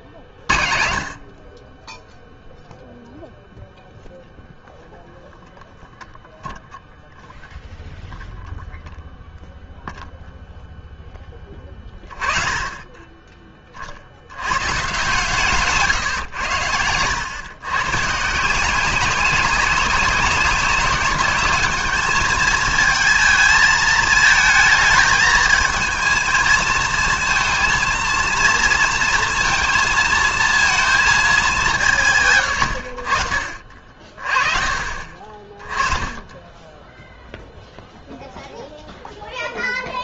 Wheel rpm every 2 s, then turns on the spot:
60, 0, 0, 0, 0, 0, 20, 140, 100, 190, 200, 220, 220, 230, 230, 220, 70, 30, 10, 0.
none